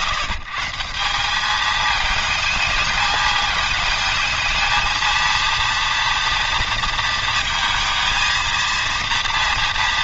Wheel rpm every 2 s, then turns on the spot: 160, 220, 230, 230, 230.
none